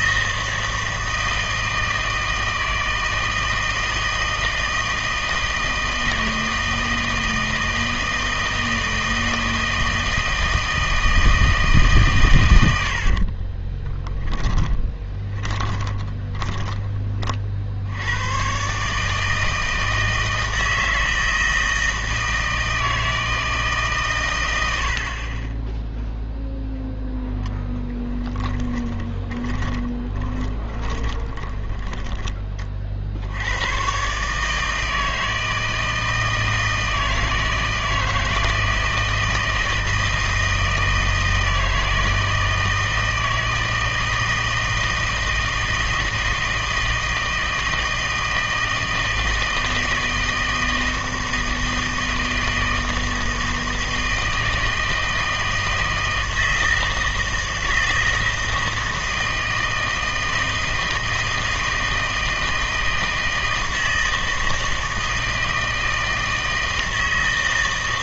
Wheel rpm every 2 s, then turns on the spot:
160, 160, 160, 160, 160, 160, 90, 10, 20, 130, 160, 160, 90, 0, 10, 20, 30, 150, 160, 160, 160, 160, 160, 160, 160, 160, 160, 160, 160, 160, 160, 160, 160, 160.
14-18 28-32